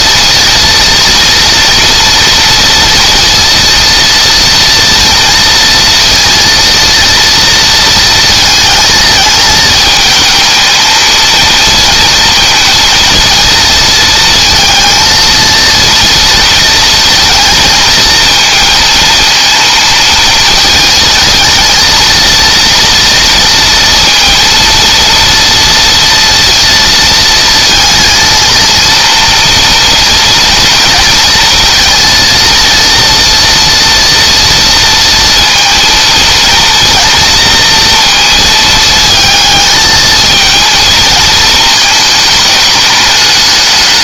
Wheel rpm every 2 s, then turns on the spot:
230, 230, 230, 230, 220, 220, 230, 230, 230, 230, 230, 230, 230, 230, 230, 230, 230, 230, 230, 220, 230, 210.
none